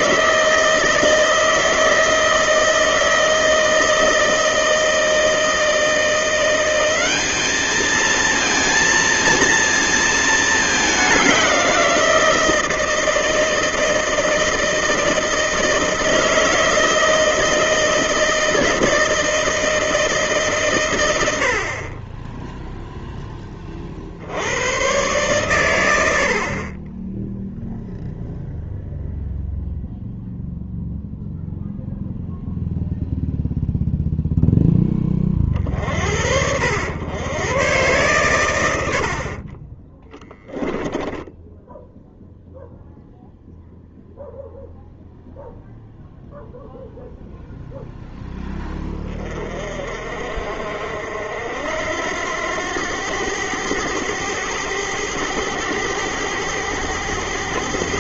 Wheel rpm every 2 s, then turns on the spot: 160, 160, 160, 180, 230, 210, 160, 160, 160, 160, 140, 10, 100, 50, 0, 0, 0, 0, 80, 100, 10, 0, 0, 0, 10, 60, 90, 100, 100.
40-42